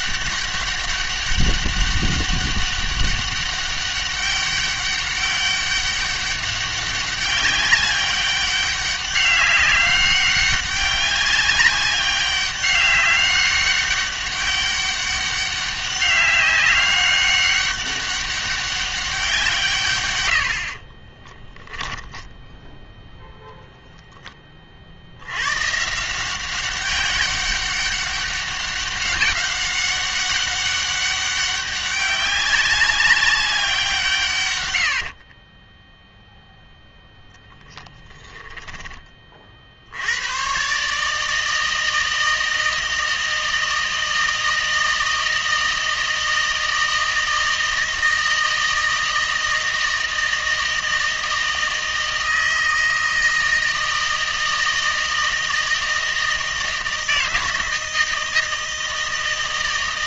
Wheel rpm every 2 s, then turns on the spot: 200, 200, 200, 200, 200, 200, 200, 200, 200, 200, 50, 10, 60, 190, 200, 200, 190, 80, 0, 20, 140, 160, 160, 160, 160, 160, 160, 160, 160, 160.
20-22 34-36